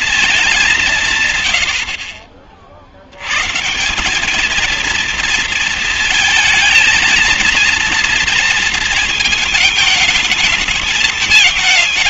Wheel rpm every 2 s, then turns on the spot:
210, 50, 210, 230, 220, 220.
none